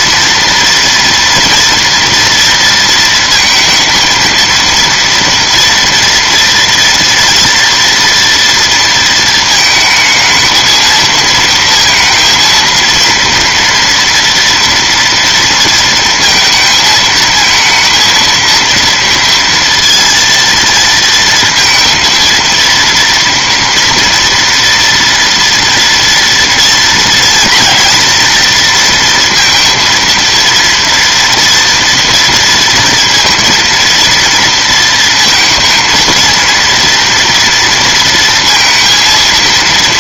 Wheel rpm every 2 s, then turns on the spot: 230, 230, 230, 230, 230, 220, 230, 240, 230, 230, 230, 230, 230, 230, 230, 230, 230, 230, 230, 230.
none